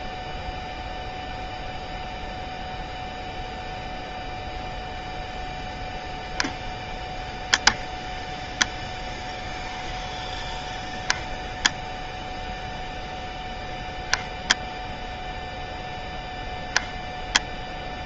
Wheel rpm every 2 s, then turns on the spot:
0, 0, 0, 0, 0, 0, 0, 0, 0.
none